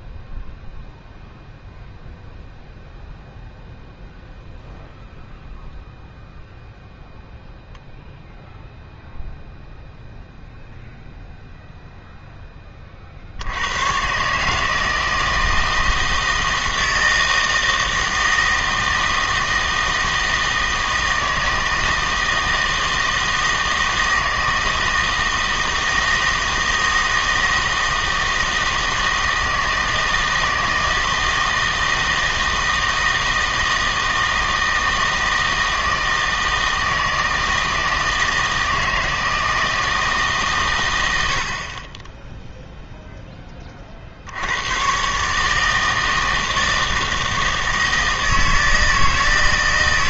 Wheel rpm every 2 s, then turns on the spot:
0, 0, 0, 0, 0, 0, 30, 160, 160, 160, 160, 160, 160, 160, 160, 160, 160, 160, 160, 160, 120, 0, 100, 160, 160.
none